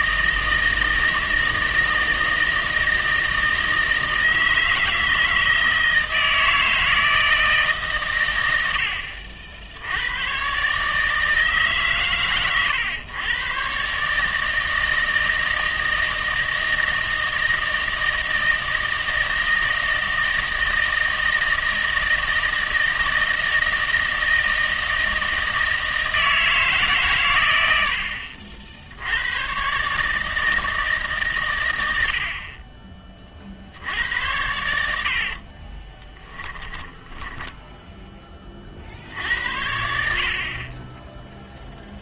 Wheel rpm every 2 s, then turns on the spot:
160, 160, 160, 160, 80, 140, 110, 160, 160, 160, 160, 160, 160, 150, 60, 160, 30, 80, 10, 40, 30.
36-38 40-42